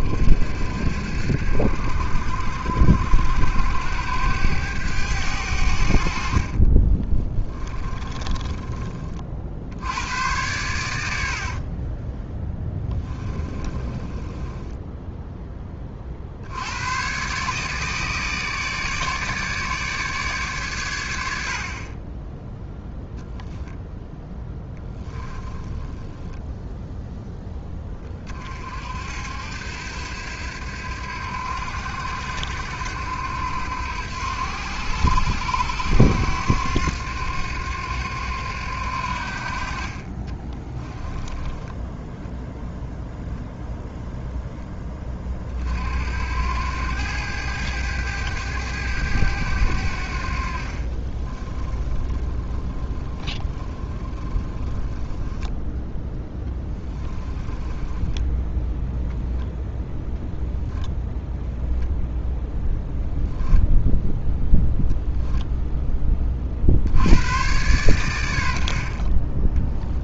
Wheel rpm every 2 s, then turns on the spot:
70, 80, 90, 20, 50, 80, 20, 10, 130, 150, 80, 10, 10, 0, 70, 80, 80, 90, 90, 70, 10, 0, 30, 100, 100, 30, 10, 10, 10, 0, 0, 0, 0, 100, 30.
6-8 10-14 24-26 40-42 50-58